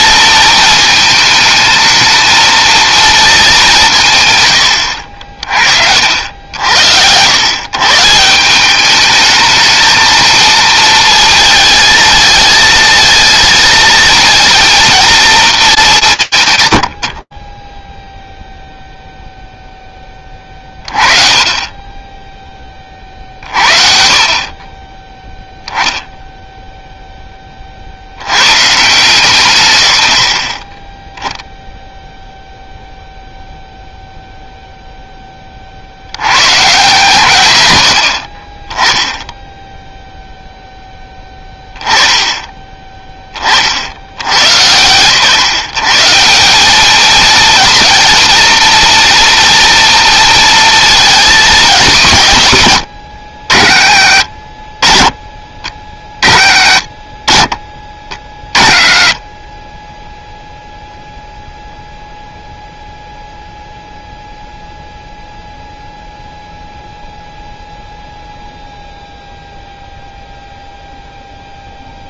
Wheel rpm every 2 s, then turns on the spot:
220, 220, 120, 70, 180, 220, 220, 230, 140, 0, 20, 20, 20, 0, 160, 10, 0, 10, 140, 10, 10, 20, 130, 220, 230, 230, 90, 40, 50, 30, 0, 0, 0, 0, 0, 0.
none